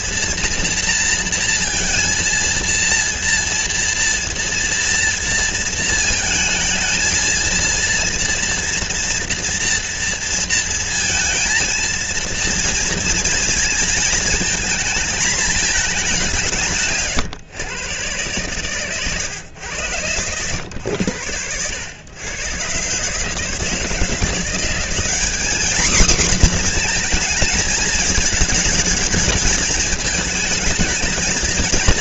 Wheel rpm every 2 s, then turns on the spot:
230, 230, 230, 220, 230, 230, 230, 220, 150, 120, 100, 130, 200, 240, 220, 220.
18-20